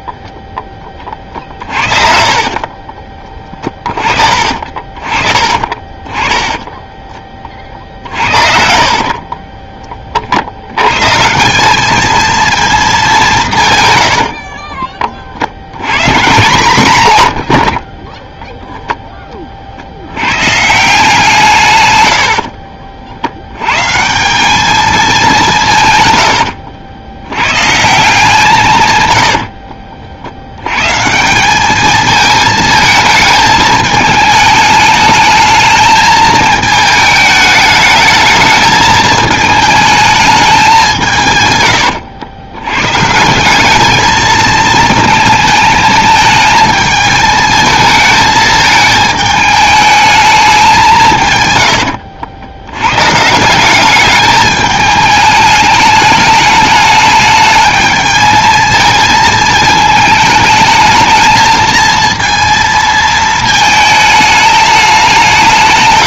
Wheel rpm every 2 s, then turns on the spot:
20, 40, 40, 10, 50, 90, 220, 40, 170, 0, 150, 60, 210, 100, 130, 100, 220, 210, 220, 220, 200, 120, 220, 220, 220, 190, 100, 210, 210, 220, 220, 230, 210.
2-4 6-10 14-16 22-24